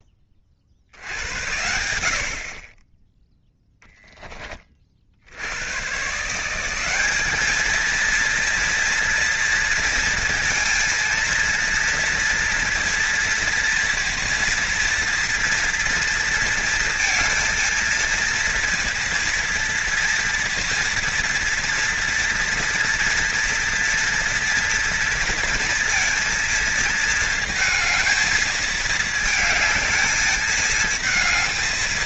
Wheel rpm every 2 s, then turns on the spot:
60, 20, 40, 180, 230, 230, 230, 230, 230, 230, 230, 230, 230, 230, 220, 220.
none